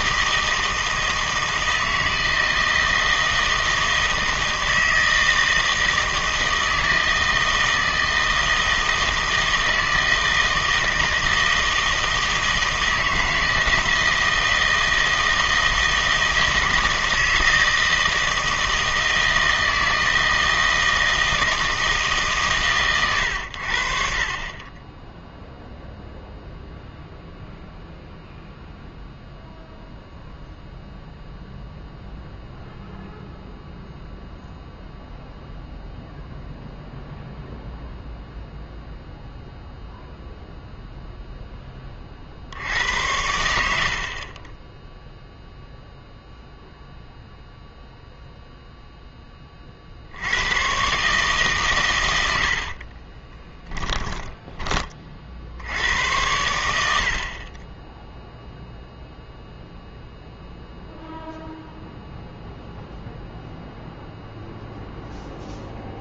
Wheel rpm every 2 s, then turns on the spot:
160, 160, 160, 160, 160, 160, 160, 160, 160, 160, 160, 140, 20, 0, 0, 0, 0, 0, 0, 0, 0, 80, 10, 0, 0, 110, 60, 20, 90, 0, 0, 0, 0.
52-54